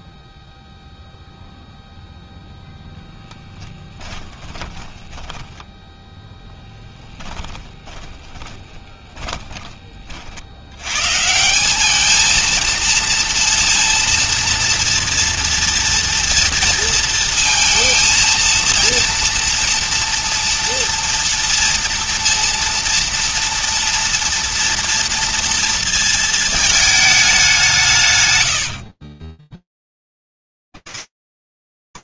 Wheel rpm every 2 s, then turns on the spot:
0, 20, 10, 10, 20, 180, 230, 230, 230, 230, 230, 230, 230, 190, 0, 20.
2-4 6-8